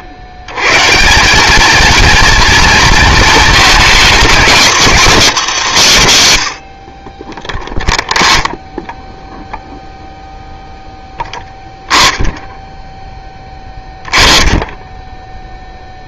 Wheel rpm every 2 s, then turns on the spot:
110, 230, 230, 70, 0, 0, 10, 20.
none